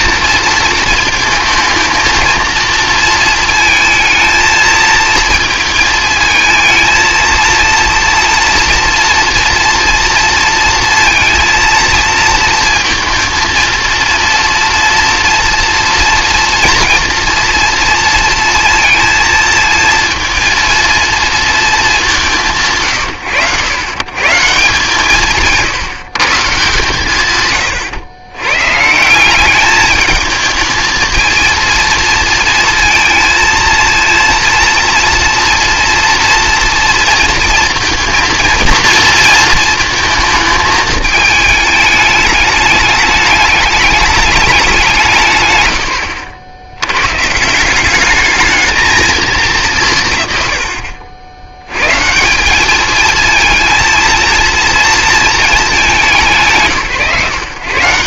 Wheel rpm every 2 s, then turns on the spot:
230, 230, 230, 220, 230, 230, 230, 230, 240, 230, 230, 90, 150, 150, 130, 220, 230, 230, 230, 230, 220, 210, 210, 60, 220, 60, 200, 230, 130.
none